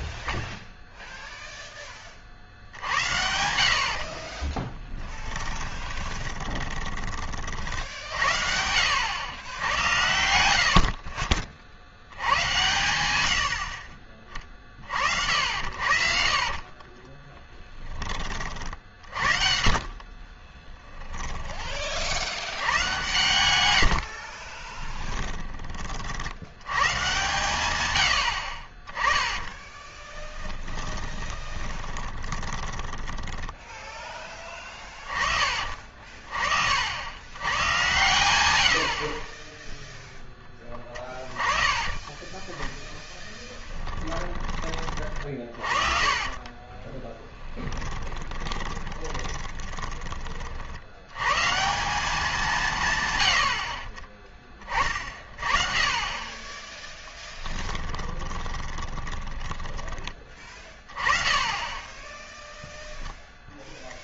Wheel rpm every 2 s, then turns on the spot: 30, 60, 20, 20, 70, 60, 110, 50, 30, 50, 20, 100, 20, 130, 20, 20, 10, 30, 90, 40, 10, 0, 30, 20, 20, 80, 140, 30, 20, 20, 20, 0.
4-8 16-22 28-34 44-50 56-60